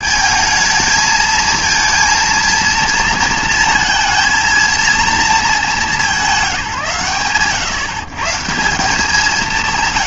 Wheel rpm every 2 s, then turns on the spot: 220, 230, 230, 140, 170.
none